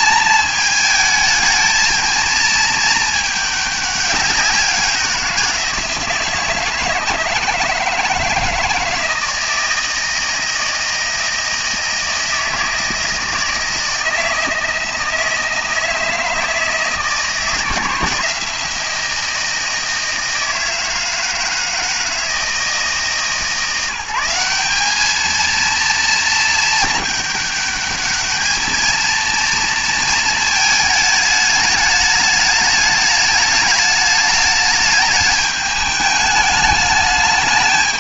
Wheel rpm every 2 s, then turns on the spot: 220, 220, 190, 160, 160, 160, 160, 160, 160, 170, 160, 160, 190, 220, 220, 220, 210, 210, 210.
none